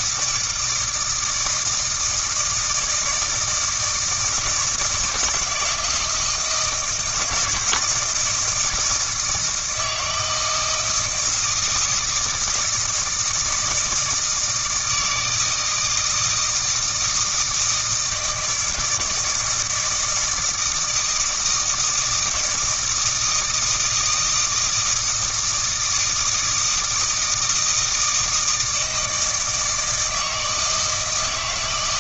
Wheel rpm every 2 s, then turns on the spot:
160, 160, 160, 160, 160, 160, 160, 160, 160, 160, 160, 170, 160, 160, 160, 160.
none